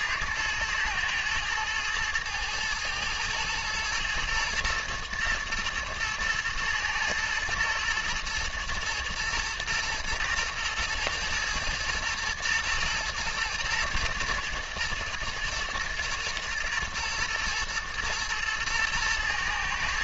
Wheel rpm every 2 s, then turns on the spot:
110, 110, 120, 110, 120, 120, 110, 110, 110, 120.
none